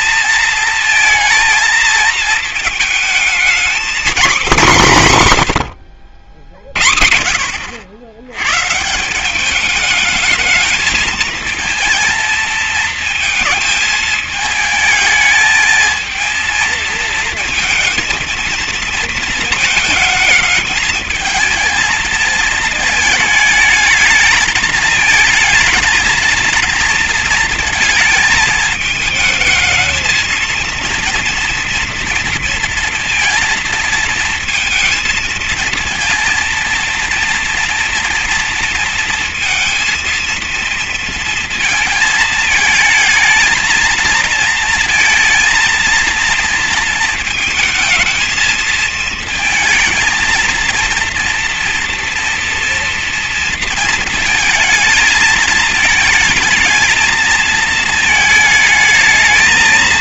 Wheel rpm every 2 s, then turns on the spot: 220, 220, 170, 50, 150, 220, 220, 220, 230, 230, 220, 220, 220, 230, 210, 220, 230, 220, 230, 230, 230, 220, 230, 230, 220, 230, 230, 220, 220, 220.
none